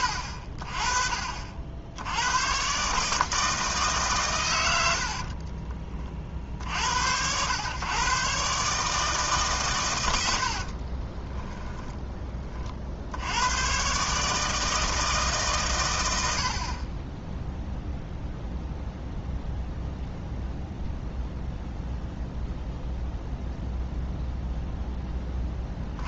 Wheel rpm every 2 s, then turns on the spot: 50, 140, 90, 60, 150, 40, 50, 160, 40, 0, 0, 0, 10.
10-12